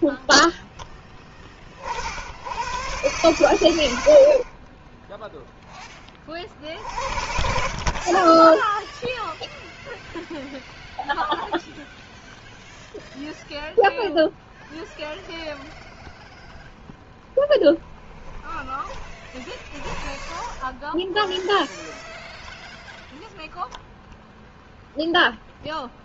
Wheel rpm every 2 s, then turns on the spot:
10, 100, 30, 60, 10, 0, 0, 0, 0, 20, 10, 0, 0.
8-10 18-22